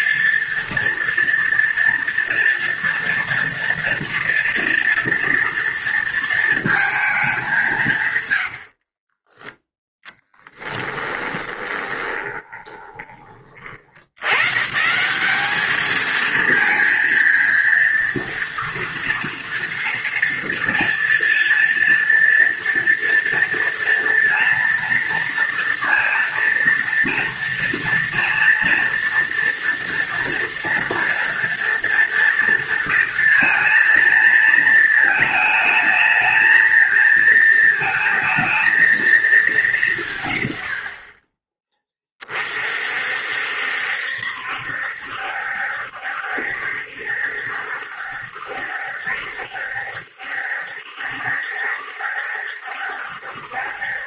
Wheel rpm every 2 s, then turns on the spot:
230, 230, 240, 230, 60, 10, 20, 140, 220, 230, 230, 230, 230, 230, 240, 240, 230, 220, 220, 230, 60, 50, 70, 70, 70, 70, 70.
8-14